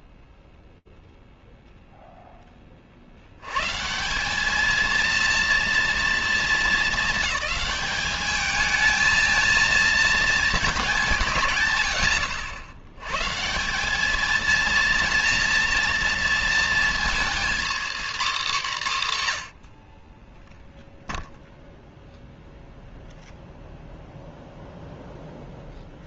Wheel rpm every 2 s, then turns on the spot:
0, 20, 210, 230, 210, 210, 80, 230, 230, 220, 0, 0, 0.
none